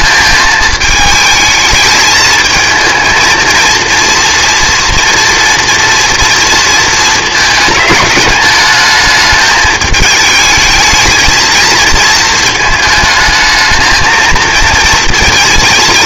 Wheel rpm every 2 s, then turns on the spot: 220, 220, 230, 230, 210, 220, 220, 230.
none